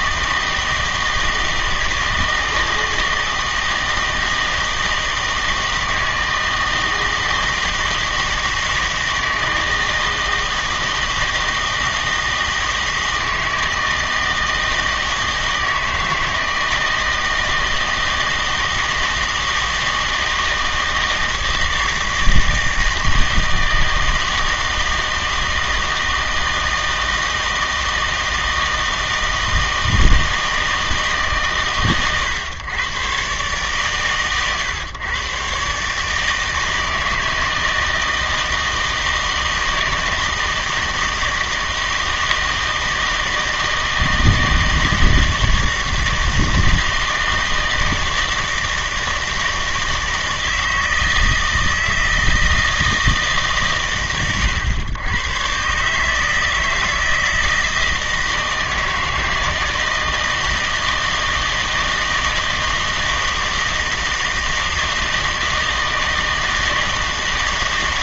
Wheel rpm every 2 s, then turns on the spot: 160, 160, 160, 160, 160, 160, 160, 160, 160, 160, 160, 160, 160, 160, 160, 160, 110, 130, 160, 160, 160, 160, 160, 160, 160, 160, 160, 110, 160, 160, 160, 160, 160, 160.
none